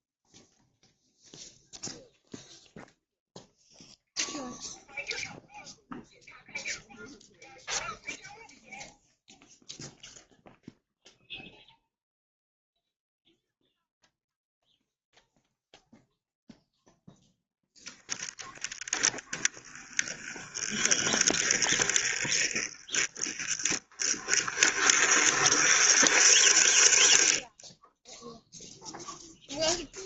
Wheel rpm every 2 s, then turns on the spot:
0, 0, 0, 0, 0, 0, 0, 0, 0, 10, 20, 30, 40, 40, 0.
none